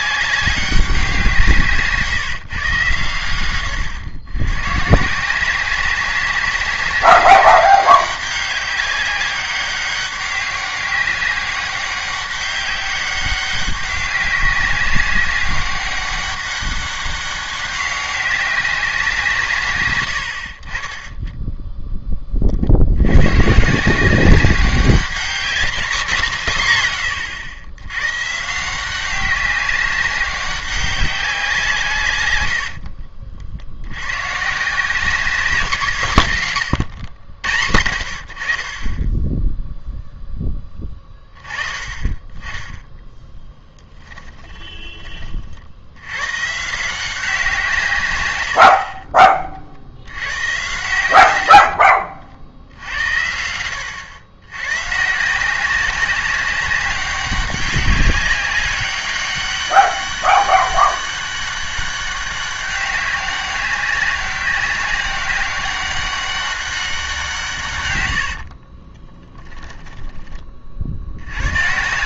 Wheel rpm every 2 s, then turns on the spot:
190, 130, 120, 190, 200, 200, 200, 200, 200, 190, 50, 60, 200, 160, 170, 190, 80, 150, 130, 50, 10, 10, 20, 160, 70, 110, 70, 120, 190, 200, 200, 200, 190, 190, 50, 40.
44-46 68-70